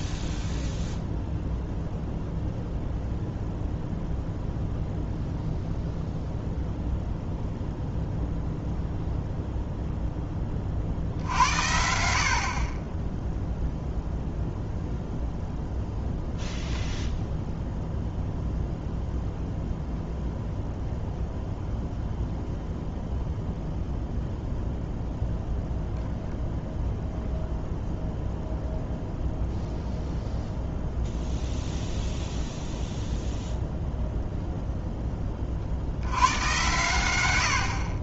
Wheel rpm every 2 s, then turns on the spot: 0, 0, 0, 0, 0, 50, 30, 0, 0, 0, 0, 0, 0, 0, 0, 0, 0, 0, 110.
none